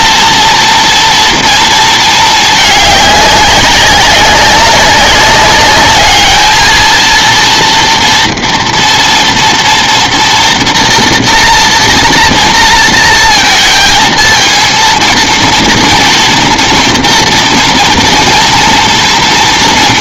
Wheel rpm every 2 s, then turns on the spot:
230, 210, 200, 220, 230, 230, 230, 230, 230, 230.
none